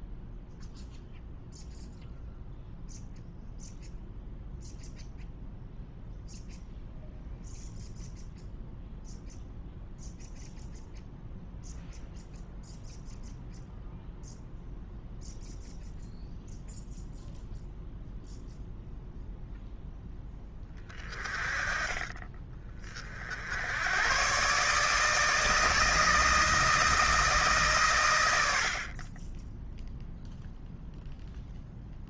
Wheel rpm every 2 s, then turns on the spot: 0, 0, 0, 0, 0, 0, 0, 0, 0, 0, 20, 40, 150, 160, 60, 0.
none